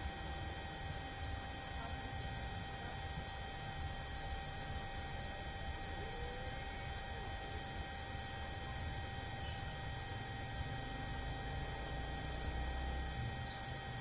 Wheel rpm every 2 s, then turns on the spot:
0, 0, 0, 0, 0, 0, 0.
none